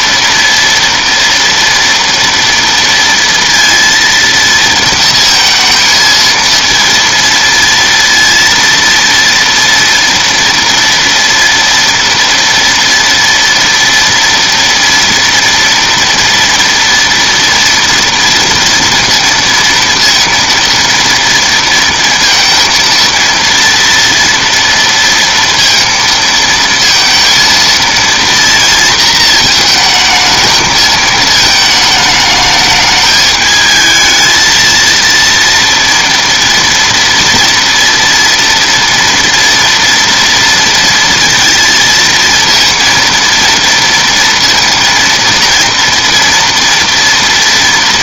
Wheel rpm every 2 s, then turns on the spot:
230, 230, 230, 230, 230, 230, 230, 230, 230, 230, 230, 230, 230, 230, 230, 220, 210, 230, 230, 230, 230, 230, 230, 230.
none